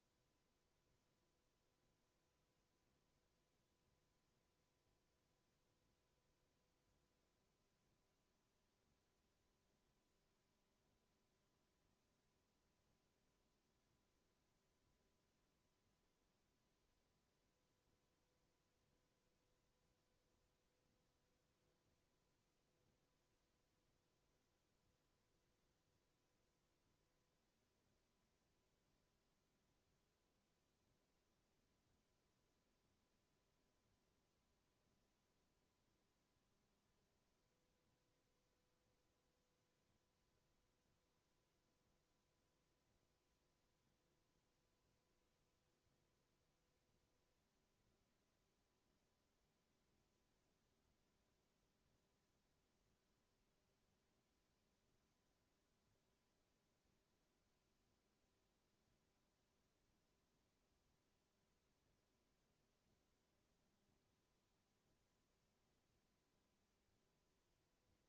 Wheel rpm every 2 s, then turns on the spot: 0, 0, 0, 0, 0, 0, 0, 0, 0, 0, 0, 0, 0, 0, 0, 0, 0, 0, 0, 0, 0, 0, 0, 0, 0, 0, 0, 0, 0, 0, 0, 0, 0, 0.
none